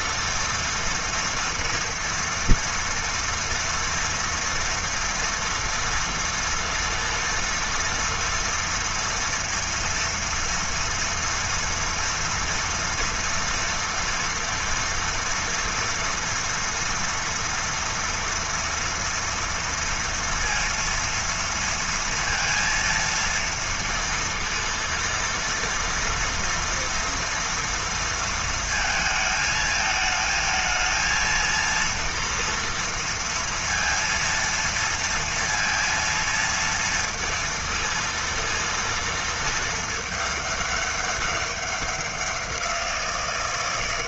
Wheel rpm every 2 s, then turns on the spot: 230, 230, 230, 230, 230, 230, 230, 230, 230, 230, 230, 230, 230, 230, 230, 220, 230, 230, 230, 230, 210, 180.
none